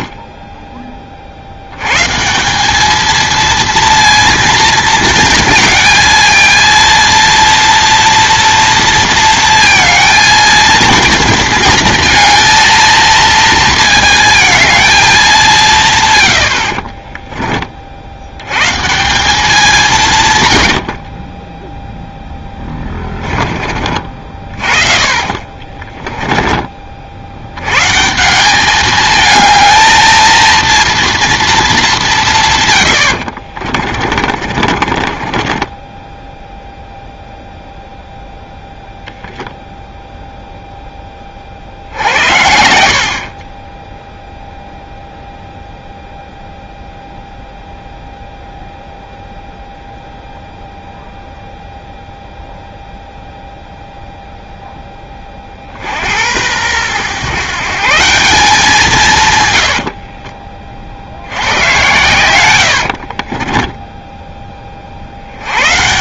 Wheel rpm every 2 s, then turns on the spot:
10, 200, 230, 230, 230, 230, 230, 220, 60, 130, 90, 10, 40, 30, 210, 230, 120, 40, 0, 0, 0, 70, 0, 0, 0, 0, 0, 10, 100, 170, 40, 90, 30.
16-18 20-26 34-36 62-64